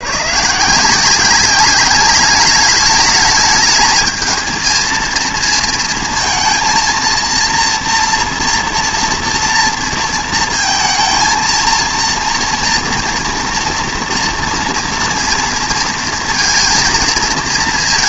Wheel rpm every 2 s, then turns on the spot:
170, 210, 230, 230, 230, 230, 230, 230, 230.
none